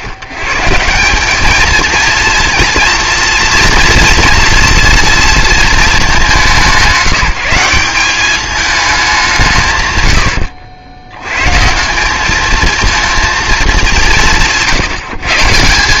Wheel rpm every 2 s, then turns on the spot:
150, 230, 230, 190, 210, 80, 220, 160.
none